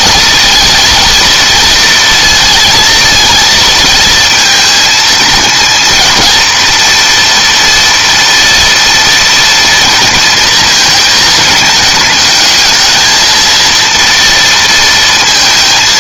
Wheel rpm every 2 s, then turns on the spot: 230, 230, 230, 230, 230, 230, 220, 230.
none